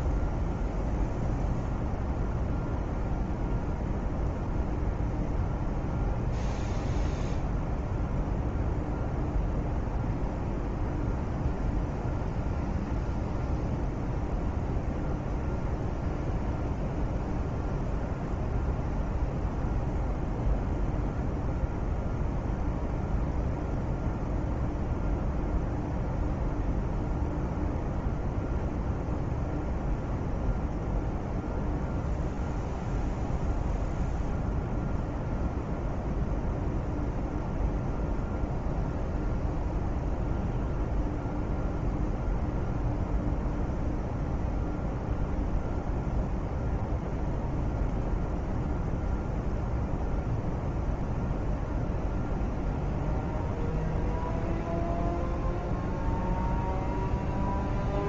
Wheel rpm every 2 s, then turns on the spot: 0, 0, 0, 0, 0, 0, 0, 0, 0, 0, 0, 0, 0, 0, 0, 0, 0, 0, 0, 0, 0, 0, 0, 0, 0, 0, 0, 0, 0.
none